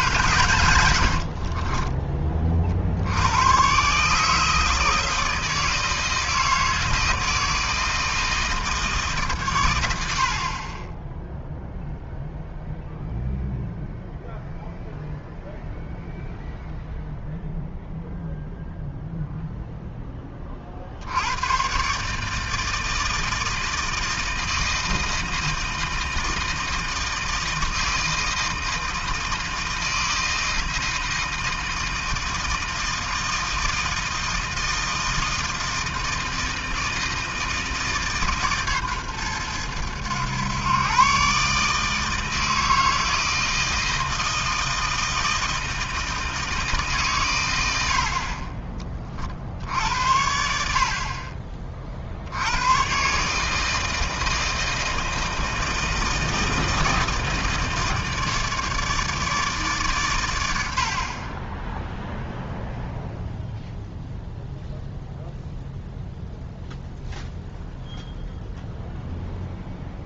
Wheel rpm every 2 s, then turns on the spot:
100, 50, 160, 160, 160, 30, 0, 0, 0, 0, 40, 160, 160, 160, 160, 160, 160, 160, 160, 140, 120, 160, 160, 150, 30, 60, 100, 160, 160, 150, 80, 0, 0, 0, 0.
0-2